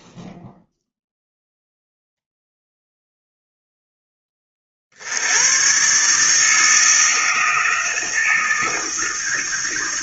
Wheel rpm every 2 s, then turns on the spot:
0, 0, 10, 130, 160.
none